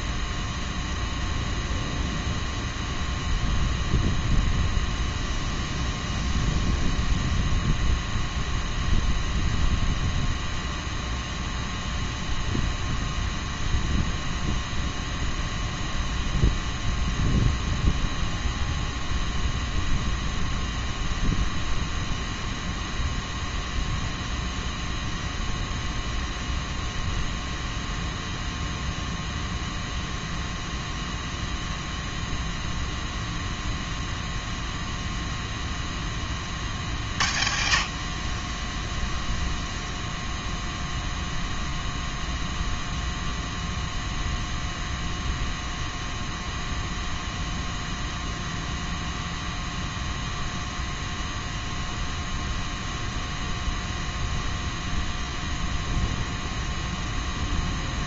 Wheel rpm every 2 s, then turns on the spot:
0, 0, 0, 0, 0, 0, 0, 0, 0, 0, 0, 0, 0, 0, 0, 0, 0, 0, 50, 10, 0, 0, 0, 0, 0, 0, 0, 0, 0.
none